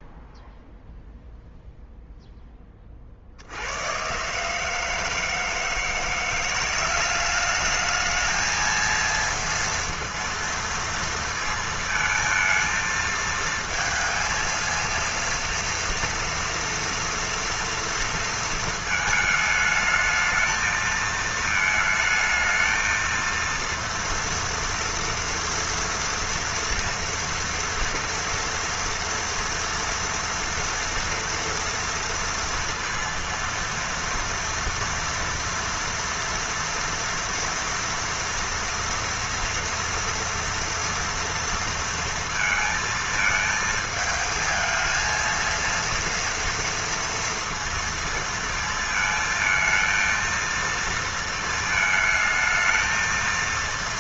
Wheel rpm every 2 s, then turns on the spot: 0, 10, 150, 180, 220, 230, 230, 230, 230, 230, 220, 220, 230, 230, 230, 240, 230, 230, 230, 230, 230, 230, 220, 230, 220, 230, 220.
none